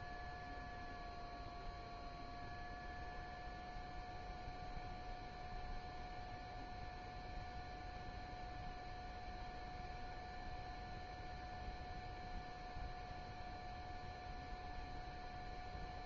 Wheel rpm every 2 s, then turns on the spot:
0, 0, 0, 0, 0, 0, 0, 0.
none